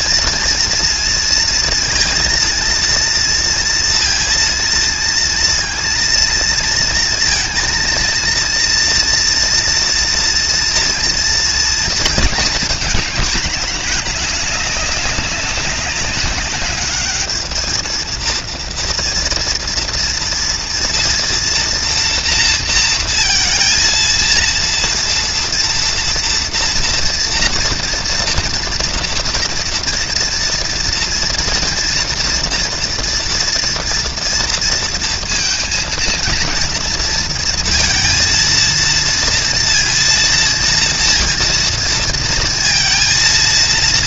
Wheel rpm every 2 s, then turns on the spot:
230, 230, 230, 230, 230, 230, 220, 200, 200, 230, 230, 230, 230, 230, 240, 230, 240, 230, 230, 230, 230, 220.
none